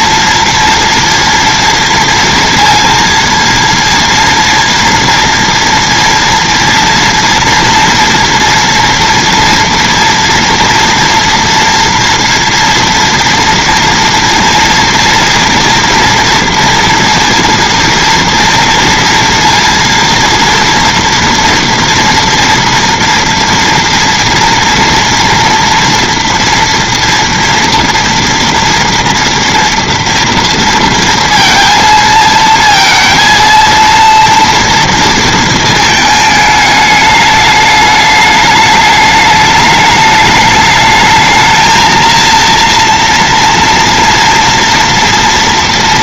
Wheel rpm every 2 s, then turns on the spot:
230, 230, 230, 230, 230, 230, 230, 230, 230, 230, 240, 230, 230, 230, 230, 230, 230, 230, 210, 210, 210, 230, 230.
none